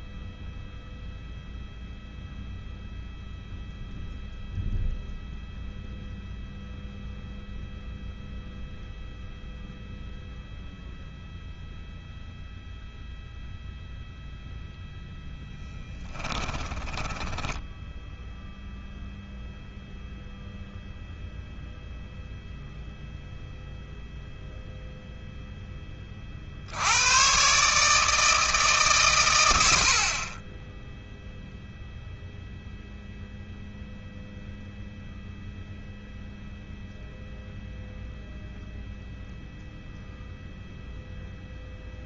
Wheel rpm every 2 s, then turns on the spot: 0, 0, 0, 0, 0, 0, 0, 0, 10, 0, 0, 0, 0, 110, 130, 10, 0, 0, 0, 0, 0.
16-18